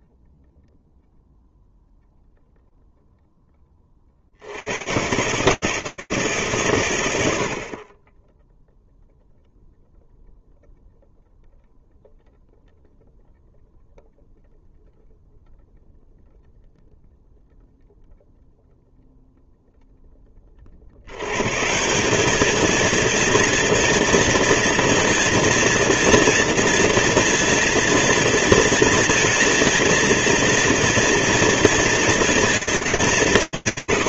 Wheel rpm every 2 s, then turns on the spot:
0, 0, 120, 100, 0, 0, 0, 0, 0, 0, 180, 230, 230, 230, 230, 230, 180.
none